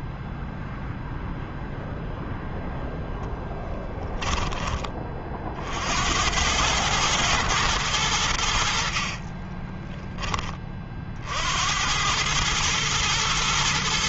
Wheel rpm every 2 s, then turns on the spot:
0, 0, 10, 80, 90, 20, 100.
none